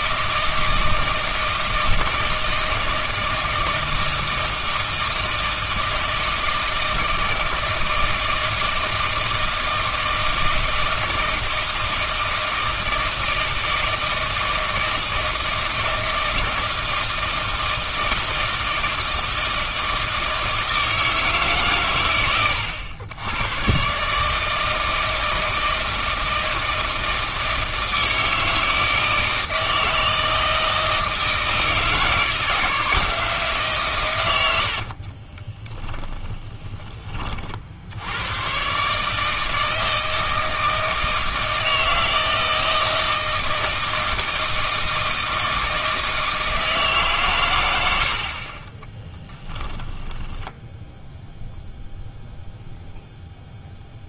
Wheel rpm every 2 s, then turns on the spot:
160, 160, 160, 160, 160, 160, 160, 160, 160, 160, 160, 90, 160, 160, 160, 160, 170, 90, 20, 130, 160, 160, 160, 150, 20, 0, 0.
34-38